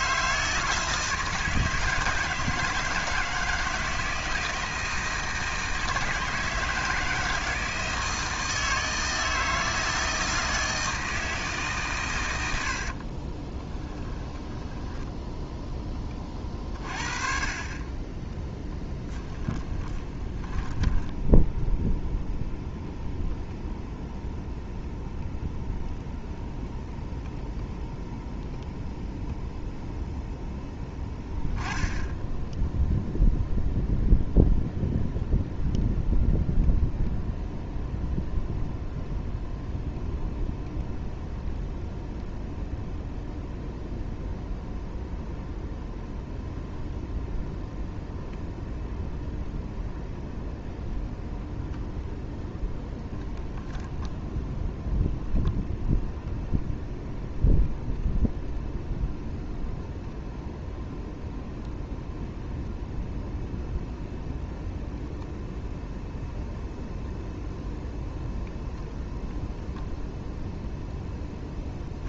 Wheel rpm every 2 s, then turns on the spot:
160, 160, 160, 160, 160, 160, 60, 10, 30, 10, 10, 0, 0, 0, 0, 0, 0, 0, 0, 0, 0, 0, 0, 0, 0, 0, 0, 0, 0, 0, 0, 0, 0, 0, 0, 0.
12-16 18-22